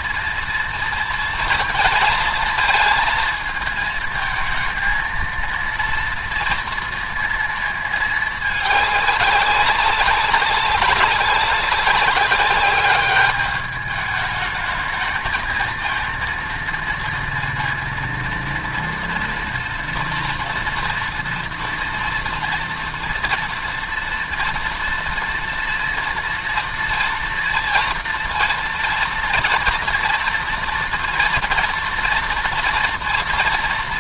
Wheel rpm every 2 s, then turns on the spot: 230, 220, 220, 230, 210, 190, 200, 210, 230, 230, 240, 230, 230, 230, 230, 230, 230.
none